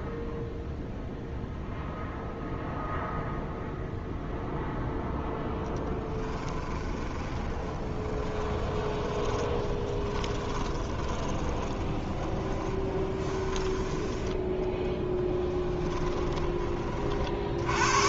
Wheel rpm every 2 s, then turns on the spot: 0, 0, 0, 20, 10, 20, 20, 20, 30.
6-16